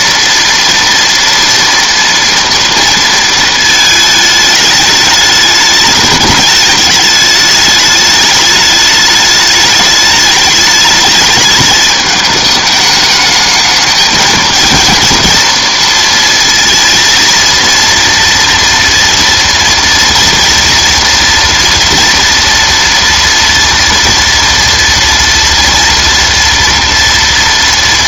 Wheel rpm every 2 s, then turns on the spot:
230, 230, 210, 210, 210, 210, 210, 230, 230, 240, 230, 230, 230, 230.
none